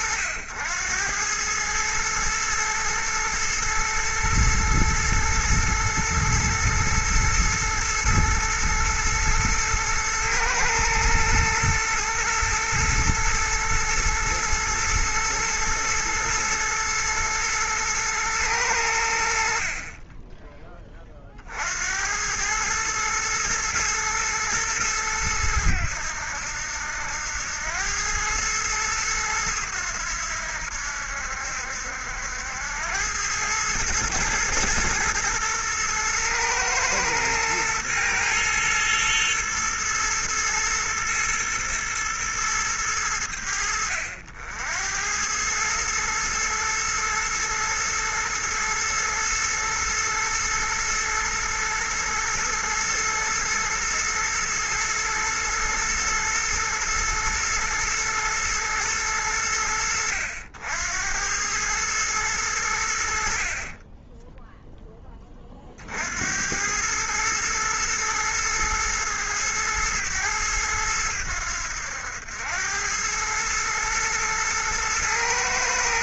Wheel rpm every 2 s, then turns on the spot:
90, 110, 120, 120, 110, 110, 120, 120, 120, 110, 20, 110, 110, 80, 110, 80, 90, 110, 110, 110, 110, 110, 80, 110, 120, 110, 120, 120, 110, 110, 80, 90, 0, 90, 110, 100, 90, 110.
none